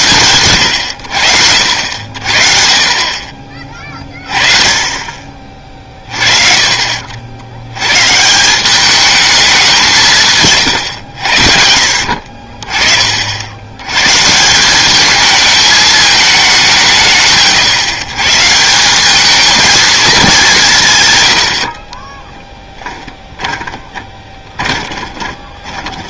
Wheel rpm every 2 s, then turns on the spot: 90, 40, 30, 50, 180, 130, 40, 180, 180, 160, 180, 10, 20.
6-8 22-26